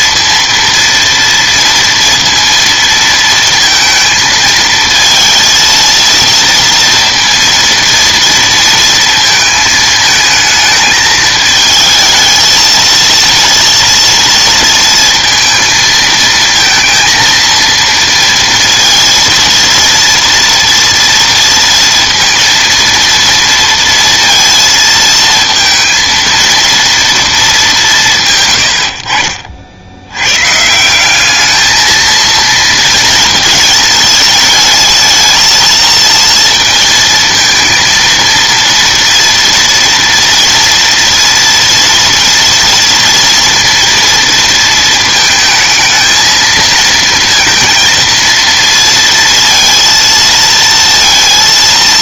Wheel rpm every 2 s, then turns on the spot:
230, 230, 220, 230, 230, 220, 220, 230, 220, 230, 230, 230, 230, 230, 110, 140, 230, 220, 230, 230, 230, 230, 230, 230, 230, 230.
none